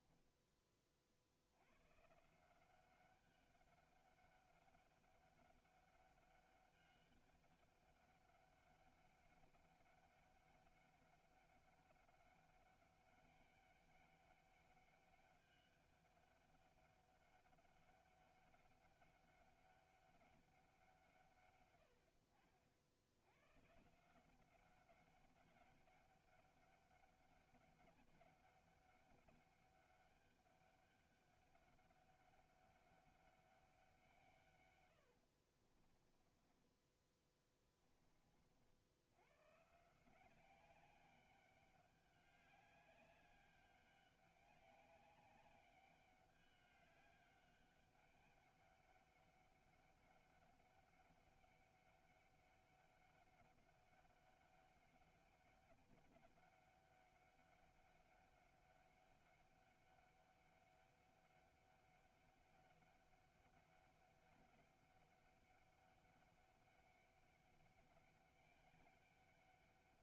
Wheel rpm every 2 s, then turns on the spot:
30, 190, 200, 200, 200, 200, 200, 200, 200, 200, 190, 70, 190, 200, 200, 200, 200, 120, 20, 60, 190, 200, 200, 200, 200, 200, 200, 200, 200, 200, 200, 200, 200, 200, 200.
36-38